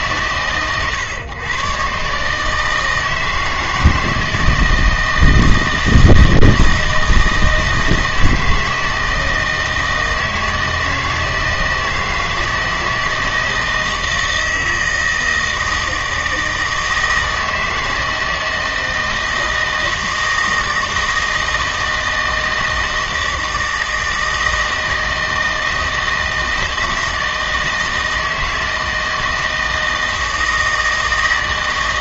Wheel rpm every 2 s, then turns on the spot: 130, 160, 160, 160, 160, 160, 160, 160, 160, 160, 160, 160, 160, 160, 160, 160.
none